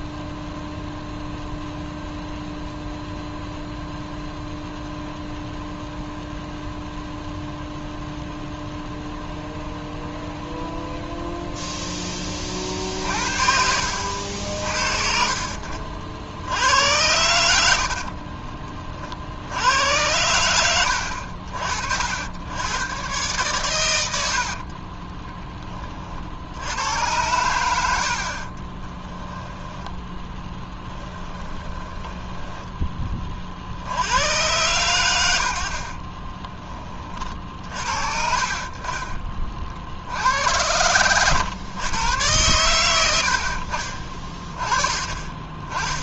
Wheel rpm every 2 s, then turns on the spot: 0, 0, 0, 0, 0, 0, 50, 40, 80, 40, 80, 110, 20, 90, 20, 10, 20, 110, 30, 30, 100, 90, 30.
24-26 28-32